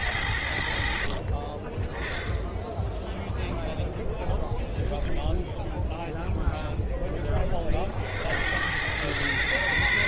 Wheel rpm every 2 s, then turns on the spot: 70, 10, 0, 0, 80.
none